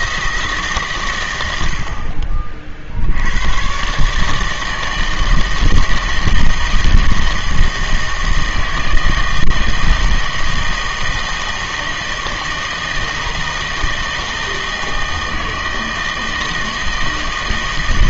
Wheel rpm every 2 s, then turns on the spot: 150, 50, 160, 160, 160, 160, 160, 160, 160.
none